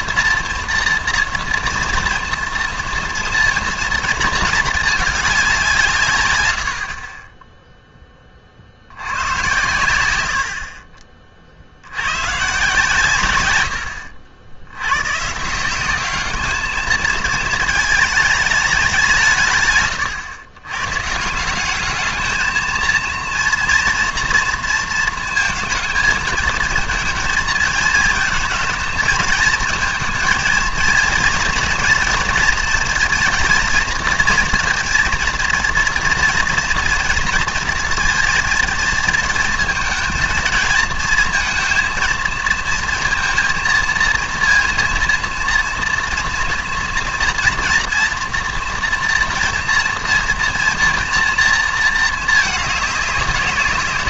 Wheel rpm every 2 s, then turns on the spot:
230, 230, 220, 90, 60, 50, 150, 80, 210, 210, 130, 220, 230, 230, 220, 230, 230, 230, 230, 230, 230, 230, 230, 230, 230, 230, 210.
none